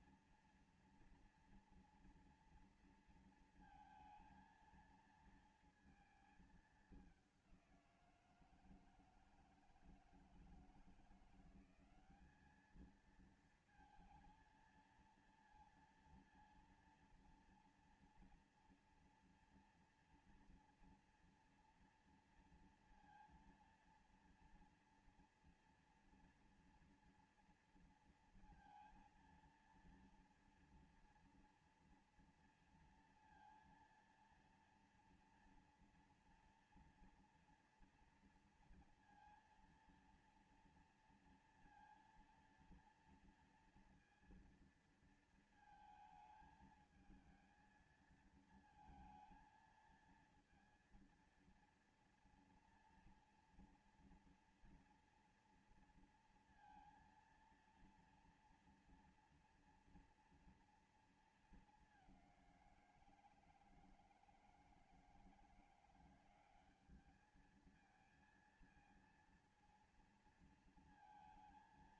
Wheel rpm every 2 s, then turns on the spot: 240, 230, 230, 210, 160, 160, 210, 230, 230, 240, 240, 230, 230, 230, 230, 230, 230, 230, 230, 230, 230, 230, 230, 220, 230, 230, 230, 230, 230, 230, 230, 180, 160, 190, 230, 230.
none